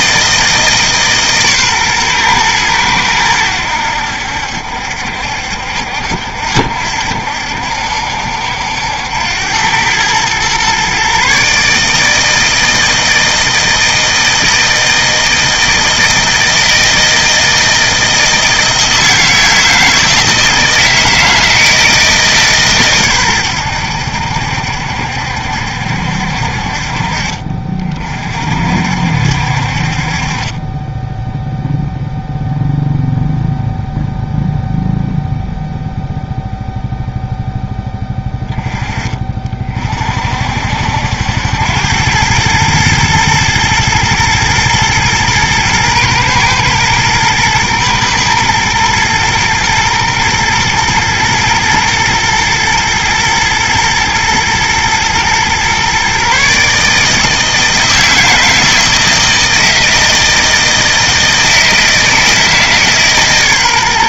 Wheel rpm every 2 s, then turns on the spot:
150, 110, 70, 70, 90, 130, 160, 160, 160, 160, 160, 130, 70, 50, 60, 20, 0, 0, 0, 20, 70, 110, 120, 110, 110, 120, 110, 120, 150, 160, 160, 150.
none